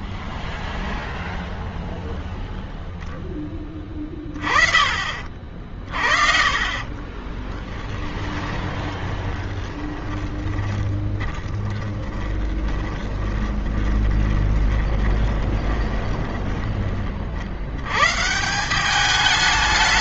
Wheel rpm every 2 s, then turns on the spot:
0, 20, 50, 20, 20, 20, 20, 10, 160, 210.
6-16